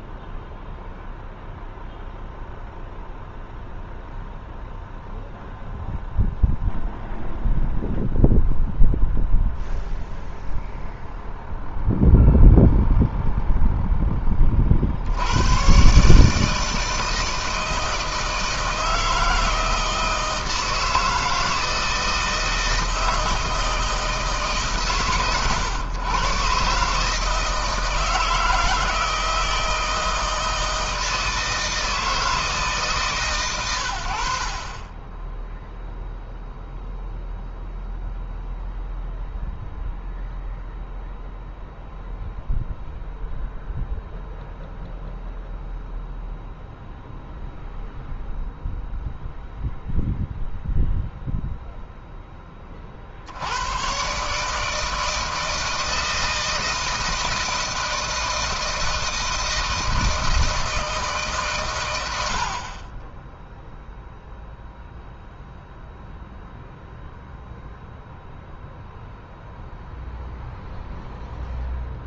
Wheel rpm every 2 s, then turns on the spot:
0, 0, 0, 0, 0, 0, 0, 40, 160, 160, 160, 160, 150, 140, 160, 160, 160, 40, 0, 0, 0, 0, 0, 0, 0, 0, 20, 140, 160, 160, 160, 60, 0, 0, 0, 0.
none